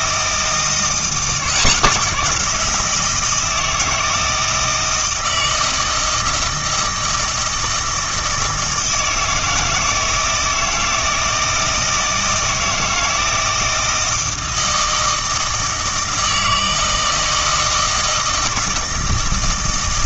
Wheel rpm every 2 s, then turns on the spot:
160, 170, 160, 160, 160, 160, 160, 160, 160, 160.
none